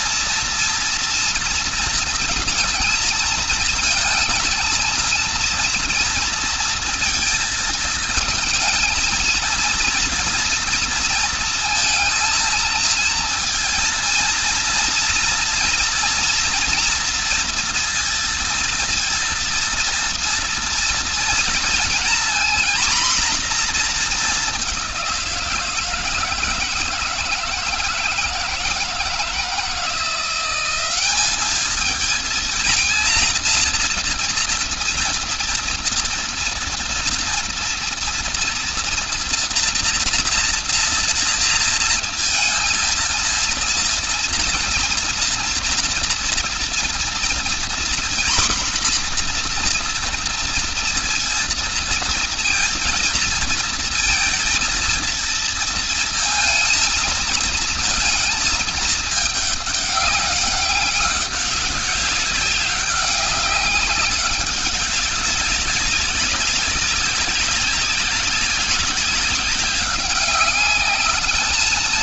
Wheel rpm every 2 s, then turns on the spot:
230, 220, 230, 230, 220, 230, 230, 230, 230, 230, 230, 240, 200, 160, 170, 180, 220, 230, 230, 240, 240, 230, 230, 230, 240, 230, 230, 230, 230, 220, 200, 190, 200, 200, 190, 200.
none